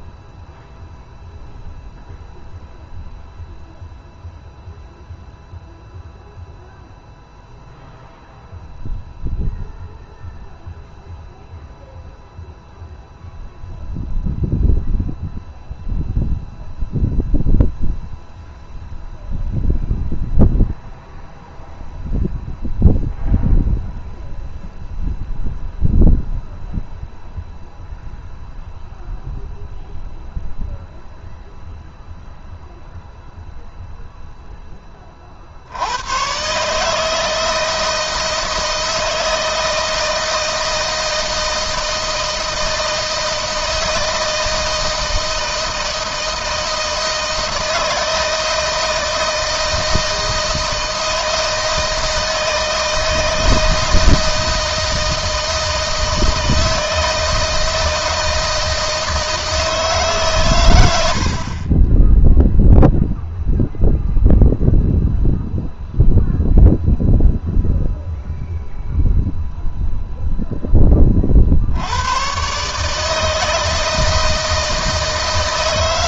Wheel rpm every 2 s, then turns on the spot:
0, 0, 0, 0, 0, 0, 0, 0, 0, 0, 0, 0, 0, 0, 0, 0, 0, 30, 150, 160, 160, 160, 160, 160, 160, 160, 160, 160, 160, 160, 90, 0, 0, 0, 0, 20, 150, 160.
none